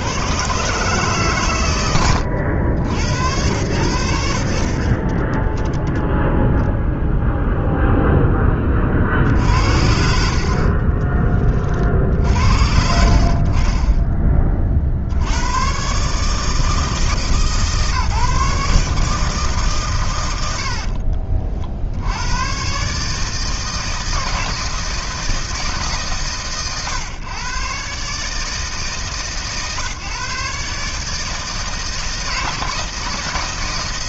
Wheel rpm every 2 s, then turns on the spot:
130, 90, 40, 0, 30, 40, 60, 40, 160, 150, 80, 130, 160, 120, 150, 150, 160.
20-22